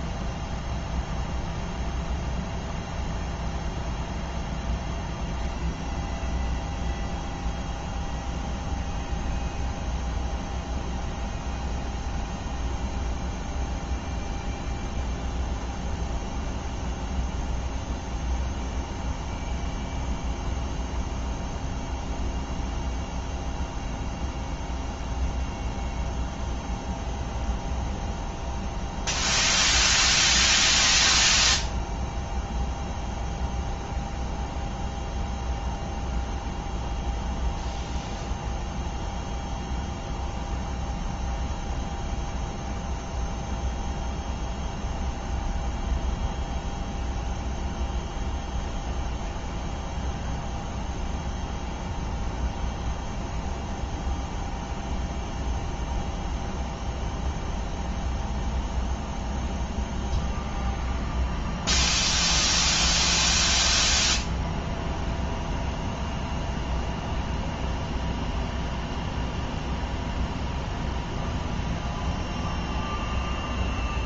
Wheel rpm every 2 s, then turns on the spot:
0, 0, 0, 0, 0, 0, 0, 0, 0, 0, 0, 0, 0, 0, 0, 0, 0, 0, 0, 0, 0, 0, 0, 0, 0, 0, 0, 0, 0, 0, 0, 0, 0, 0, 0, 0, 0.
none